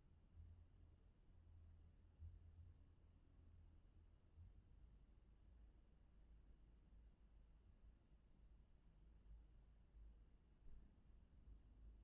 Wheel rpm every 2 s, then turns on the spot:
0, 0, 0, 0, 0, 0.
none